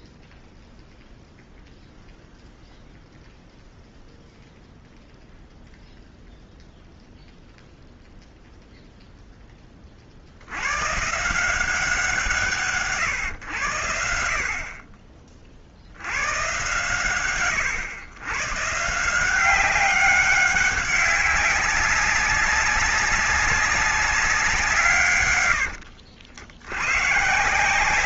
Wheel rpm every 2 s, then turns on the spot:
0, 0, 0, 0, 0, 80, 150, 50, 120, 130, 190, 190, 180, 80.
none